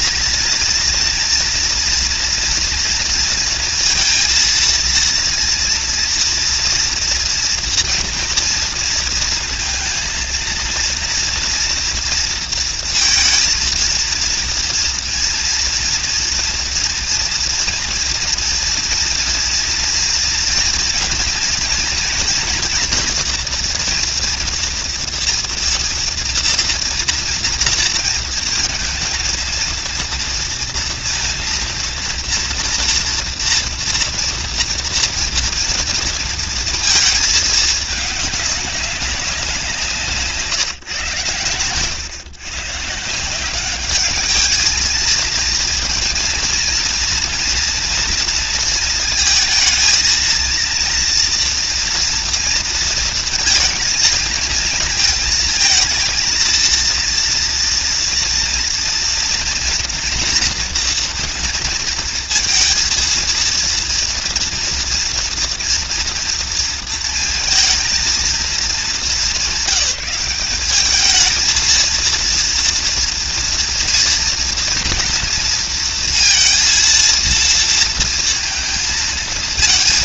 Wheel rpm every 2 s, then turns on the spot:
230, 230, 230, 240, 230, 230, 230, 230, 230, 230, 230, 230, 230, 230, 230, 230, 230, 230, 230, 200, 140, 130, 220, 230, 230, 230, 230, 230, 230, 230, 240, 230, 230, 230, 220, 200, 230, 230, 230, 230.
none